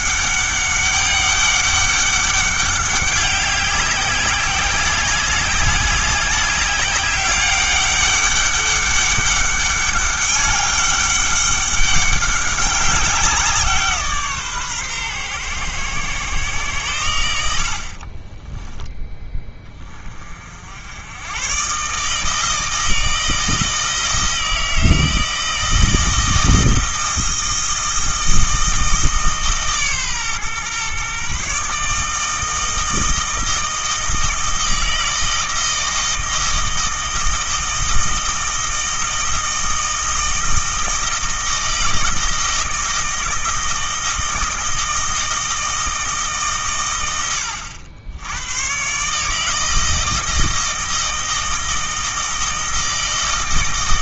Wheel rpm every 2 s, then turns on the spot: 200, 200, 190, 200, 200, 200, 200, 140, 120, 10, 70, 160, 160, 160, 160, 130, 160, 160, 160, 160, 160, 160, 160, 130, 120, 160, 160.
18-20